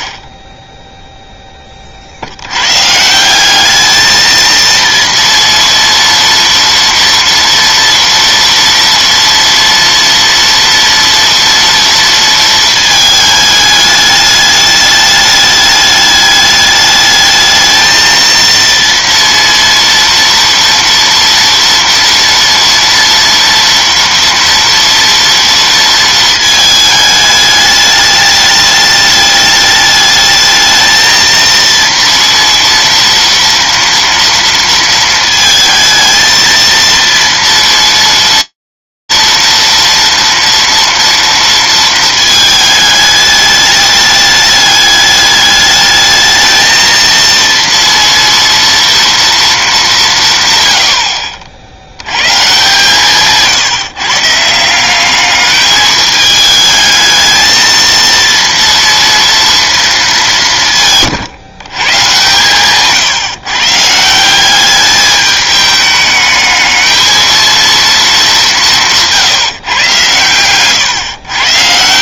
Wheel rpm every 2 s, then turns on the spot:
0, 80, 220, 230, 230, 230, 230, 210, 210, 230, 230, 240, 230, 220, 210, 210, 230, 230, 230, 230, 230, 210, 210, 220, 230, 80, 150, 180, 220, 230, 160, 140, 200, 220, 170, 120.
none